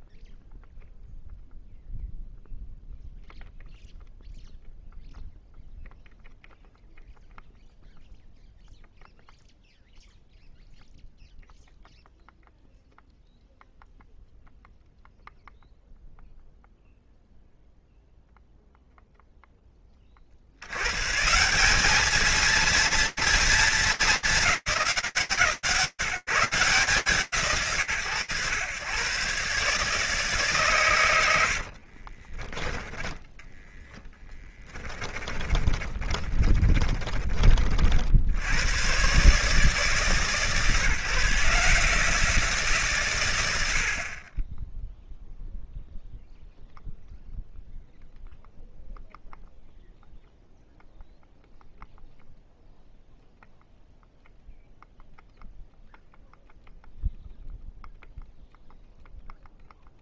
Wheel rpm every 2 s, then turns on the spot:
0, 0, 0, 0, 0, 0, 0, 0, 0, 0, 30, 220, 220, 150, 110, 150, 60, 20, 40, 90, 150, 150, 20, 0, 0, 0, 0, 0, 0, 0.
32-38